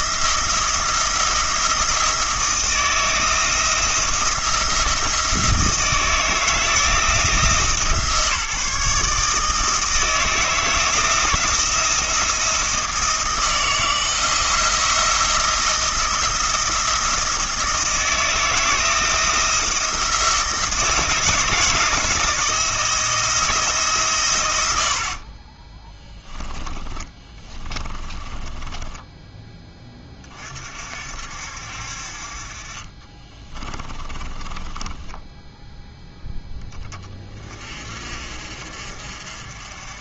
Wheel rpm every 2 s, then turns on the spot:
170, 170, 170, 170, 150, 160, 170, 170, 170, 160, 160, 160, 70, 20, 10, 50, 30, 10, 10, 50.
26-30 32-36